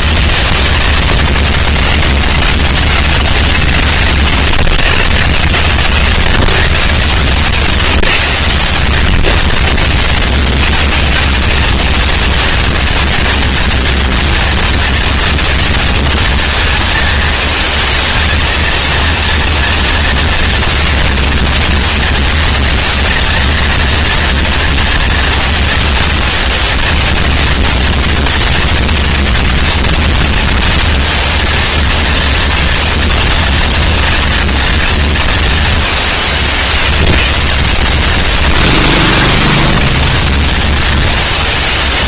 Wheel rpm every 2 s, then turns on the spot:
160, 160, 120, 140, 120, 180, 230, 230, 220, 230, 230, 230, 230, 220, 230, 230, 230, 230, 180, 100, 160.
none